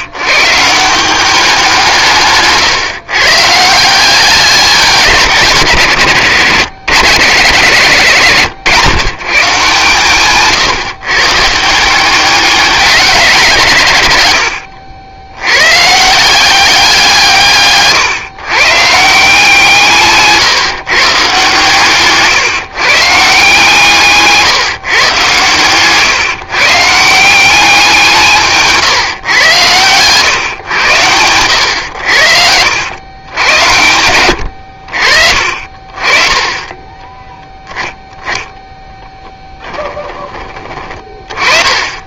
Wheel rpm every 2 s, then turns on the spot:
180, 140, 190, 130, 110, 140, 190, 90, 170, 160, 150, 150, 130, 160, 140, 100, 90, 60, 10, 10, 30.
36-40